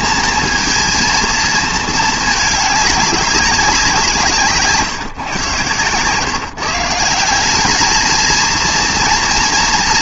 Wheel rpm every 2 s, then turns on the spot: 230, 210, 150, 150, 230.
none